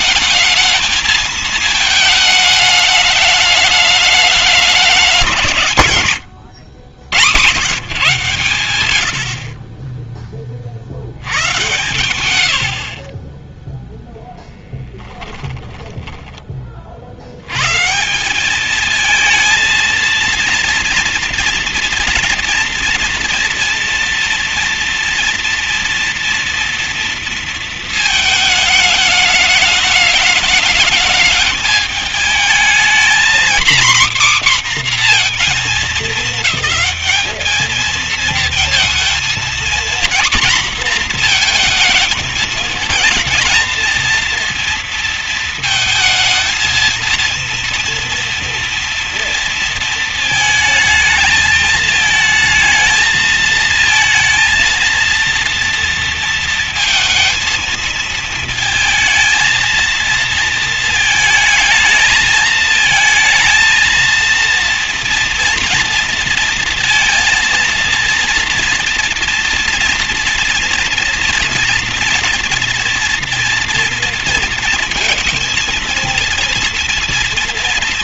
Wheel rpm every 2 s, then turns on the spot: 220, 220, 210, 100, 120, 30, 110, 10, 40, 210, 230, 230, 230, 230, 220, 220, 220, 260, 210, 220, 240, 220, 230, 230, 230, 220, 220, 230, 220, 220, 230, 220, 230, 230, 230, 230, 230, 230, 230.
12-16